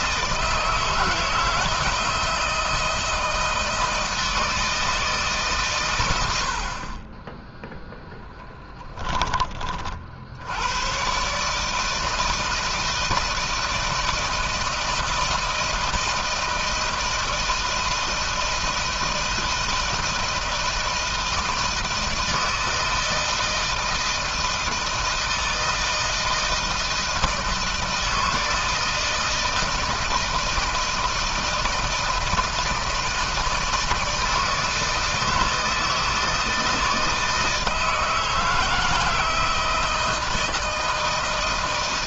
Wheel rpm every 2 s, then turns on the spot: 160, 160, 160, 50, 10, 90, 160, 160, 160, 160, 160, 160, 160, 160, 160, 160, 160, 160, 160, 160, 160.
8-10